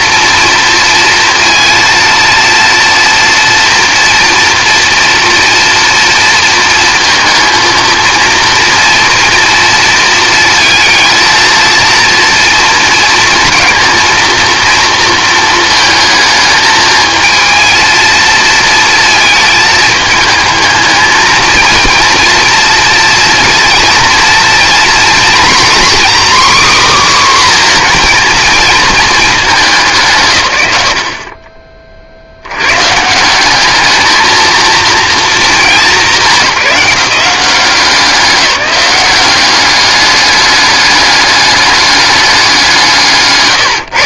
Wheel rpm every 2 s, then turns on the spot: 230, 230, 230, 230, 230, 230, 230, 230, 220, 230, 220, 230, 240, 270, 230, 110, 110, 230, 180, 190, 200, 200.
none